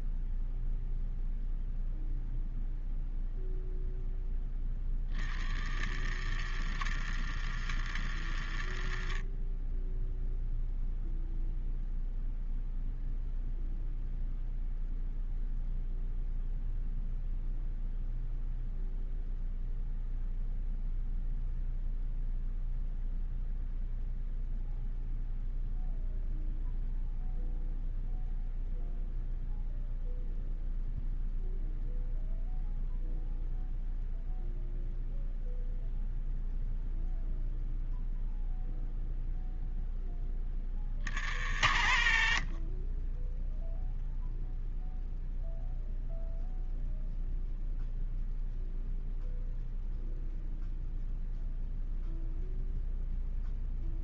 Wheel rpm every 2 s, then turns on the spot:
0, 0, 40, 80, 40, 0, 0, 0, 0, 0, 0, 0, 0, 0, 0, 0, 0, 0, 0, 0, 60, 20, 0, 0, 0, 0, 0.
none